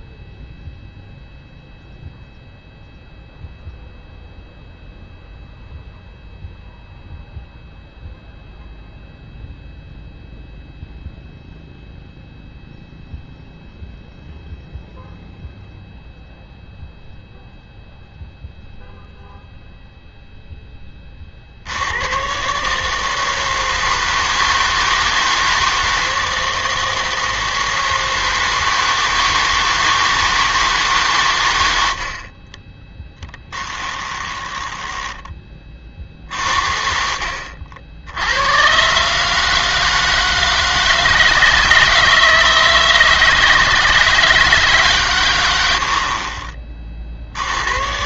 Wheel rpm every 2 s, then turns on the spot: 0, 0, 0, 0, 0, 0, 0, 0, 0, 0, 10, 140, 160, 160, 160, 160, 20, 10, 50, 130, 160, 160, 150, 40.
34-36